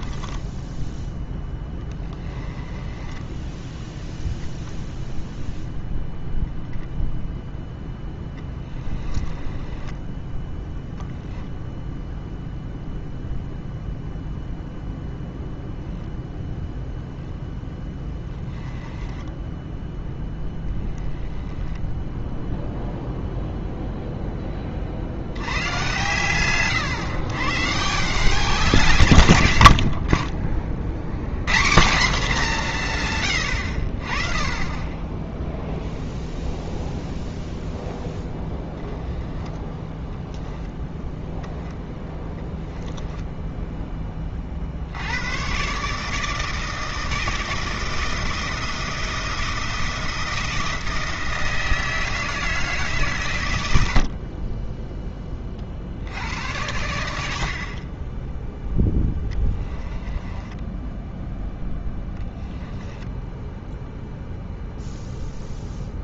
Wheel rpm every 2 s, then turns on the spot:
10, 10, 0, 10, 10, 0, 0, 0, 0, 20, 10, 0, 40, 110, 160, 70, 170, 10, 0, 20, 0, 10, 70, 160, 170, 160, 150, 10, 80, 10, 10, 10, 0.
0-4 8-10 18-20 58-60 62-64